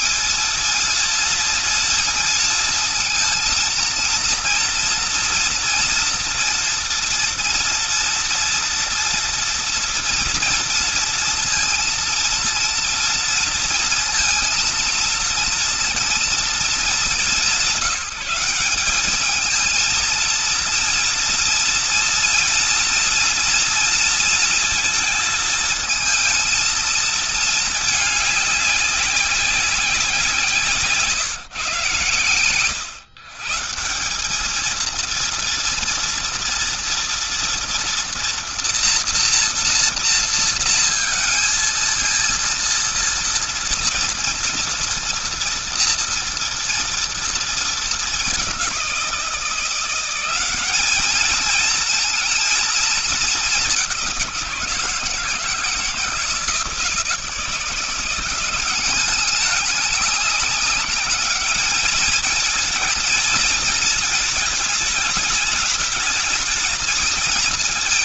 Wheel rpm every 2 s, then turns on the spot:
230, 230, 230, 230, 230, 230, 230, 230, 220, 200, 230, 240, 230, 220, 200, 160, 110, 220, 230, 230, 230, 230, 230, 230, 190, 200, 220, 160, 160, 190, 210, 230, 210, 220.
none